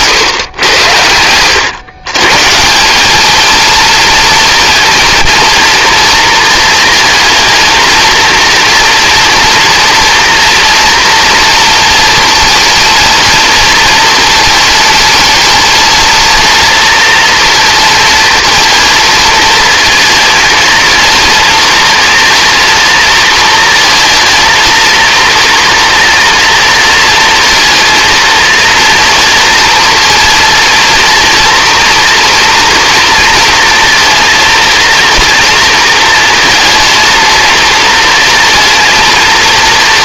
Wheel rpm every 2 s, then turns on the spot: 100, 190, 230, 230, 230, 240, 230, 220, 230, 230, 230, 230, 230, 230, 230, 230, 230, 230, 230, 230.
none